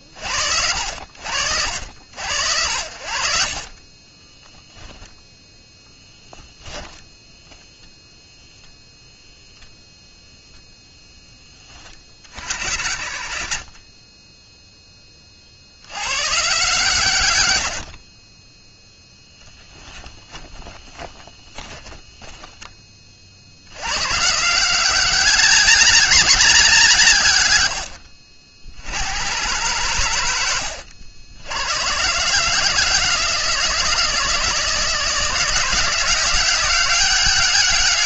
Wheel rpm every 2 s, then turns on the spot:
60, 20, 10, 10, 0, 10, 50, 30, 100, 10, 20, 40, 190, 140, 110, 80, 150, 170, 200.
2-4 20-22